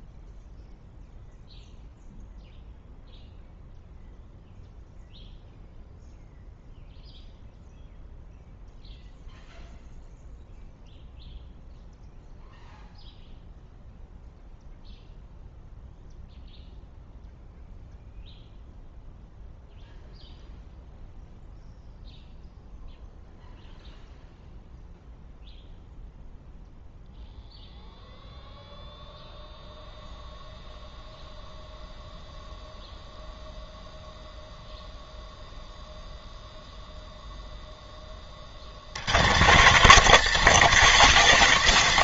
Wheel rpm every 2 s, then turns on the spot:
0, 0, 0, 0, 0, 0, 0, 0, 0, 0, 0, 0, 0, 0, 0, 0, 0, 0, 0, 110, 210.
none